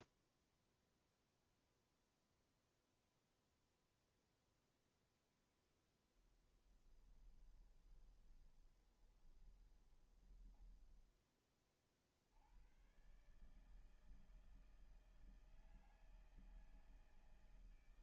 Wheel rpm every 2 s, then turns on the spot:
0, 0, 0, 10, 20, 10, 70, 160, 160.
6-12